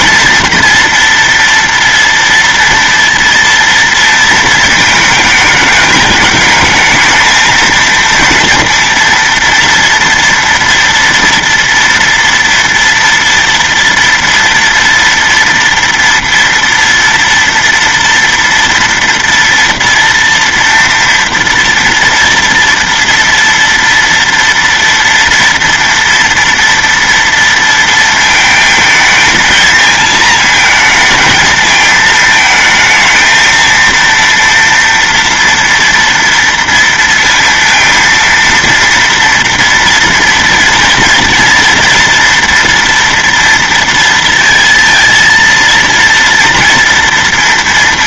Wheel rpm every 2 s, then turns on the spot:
240, 230, 220, 220, 230, 230, 230, 230, 230, 230, 230, 230, 230, 230, 220, 220, 220, 230, 230, 230, 230, 230, 230, 230.
none